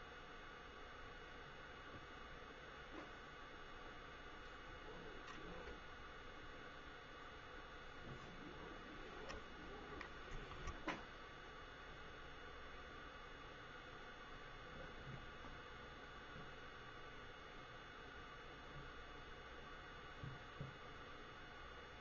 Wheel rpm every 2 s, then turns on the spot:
0, 0, 0, 0, 0, 0, 0, 0, 0, 0, 0.
none